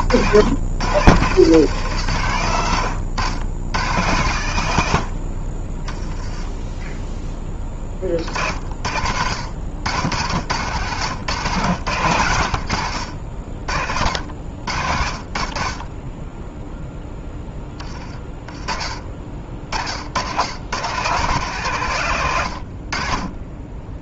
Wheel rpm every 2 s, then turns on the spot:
70, 130, 110, 10, 40, 90, 110, 60, 10, 30, 110, 70.
12-14